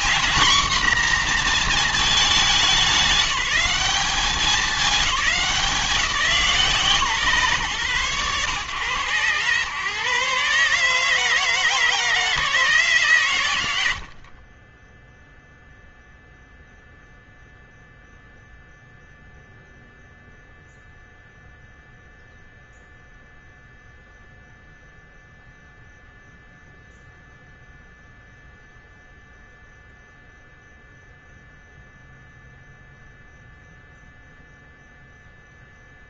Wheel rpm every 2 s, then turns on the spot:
250, 200, 200, 130, 120, 150, 150, 20, 0, 0, 0, 0, 0, 0, 0, 0, 0, 0.
14-16